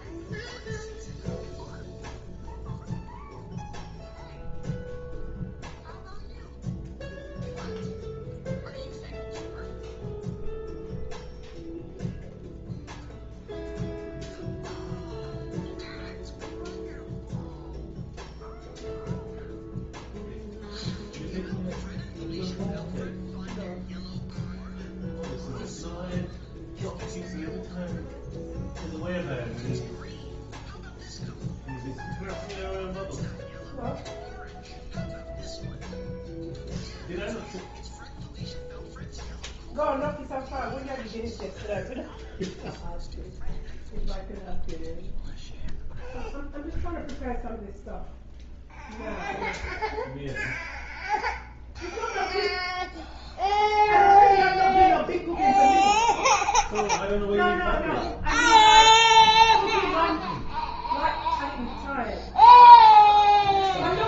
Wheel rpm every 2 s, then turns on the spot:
0, 0, 0, 0, 0, 0, 0, 0, 0, 0, 0, 0, 0, 0, 0, 0, 0, 0, 0, 0, 0, 0, 0, 0, 0, 0, 0, 0, 0, 0, 0, 0.
none